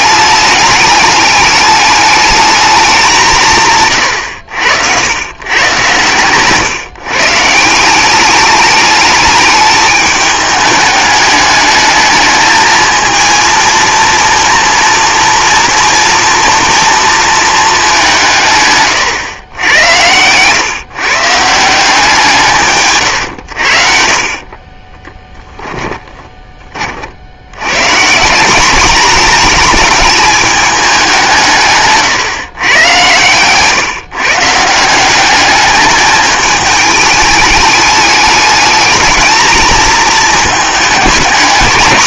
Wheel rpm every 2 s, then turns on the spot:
210, 210, 90, 140, 210, 210, 220, 230, 230, 130, 130, 140, 30, 30, 200, 210, 110, 160, 210, 220, 210.
18-20 24-26